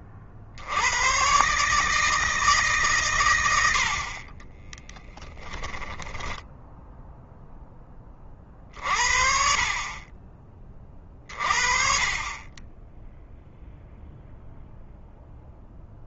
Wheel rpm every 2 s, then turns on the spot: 100, 130, 10, 10, 50, 30, 10, 0.
4-6